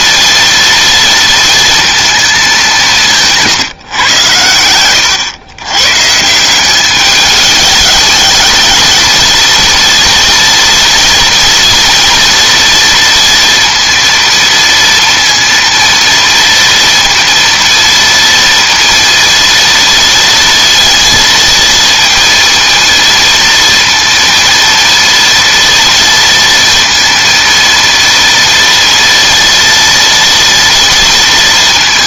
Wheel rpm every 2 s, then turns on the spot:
230, 190, 100, 190, 220, 230, 230, 230, 230, 230, 230, 230, 230, 230, 230, 230.
none